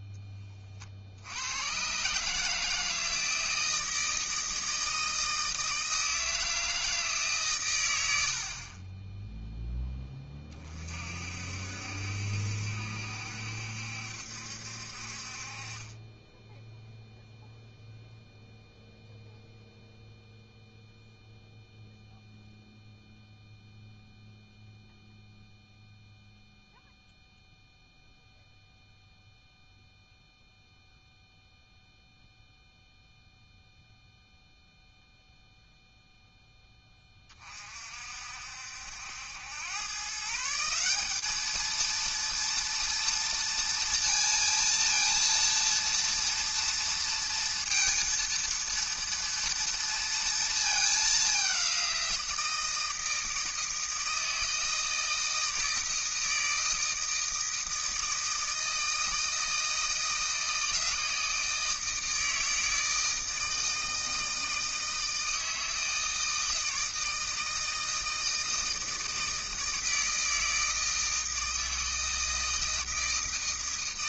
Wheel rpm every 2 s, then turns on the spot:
20, 160, 160, 160, 60, 30, 70, 60, 10, 0, 0, 0, 0, 0, 0, 0, 0, 0, 10, 60, 170, 230, 230, 230, 230, 220, 170, 160, 160, 160, 160, 160, 160, 160, 160, 160, 160.
8-10